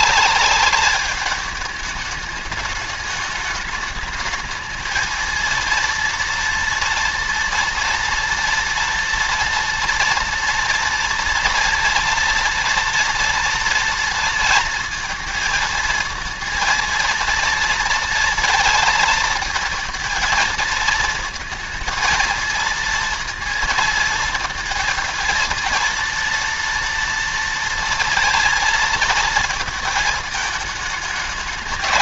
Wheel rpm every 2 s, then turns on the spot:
210, 210, 220, 230, 230, 230, 230, 230, 230, 230, 230, 230, 230, 230, 230, 220.
none